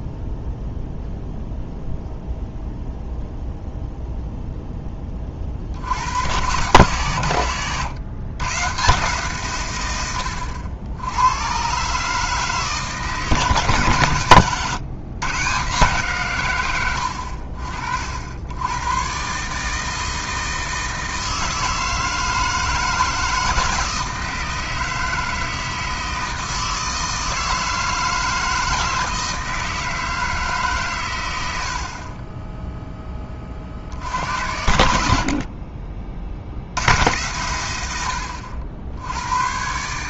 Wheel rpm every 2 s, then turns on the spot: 0, 0, 10, 120, 140, 80, 150, 120, 100, 110, 160, 160, 160, 160, 160, 140, 10, 70, 90, 70.
none